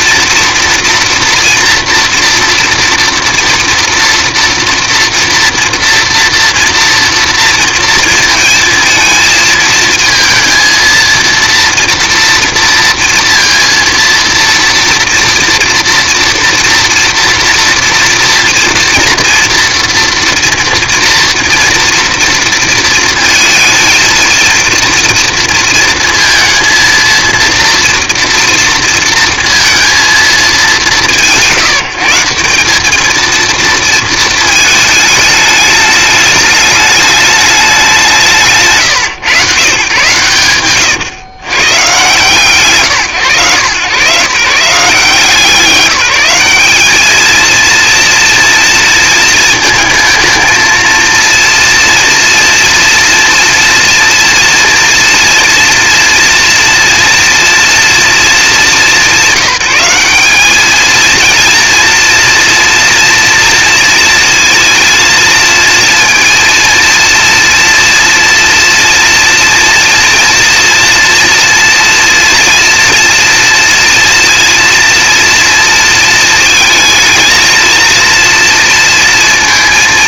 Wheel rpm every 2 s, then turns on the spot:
230, 240, 230, 230, 230, 230, 230, 230, 230, 230, 230, 230, 230, 230, 230, 200, 200, 220, 210, 160, 120, 140, 150, 210, 230, 230, 230, 230, 230, 200, 210, 230, 230, 230, 230, 240, 230, 230, 220, 230.
none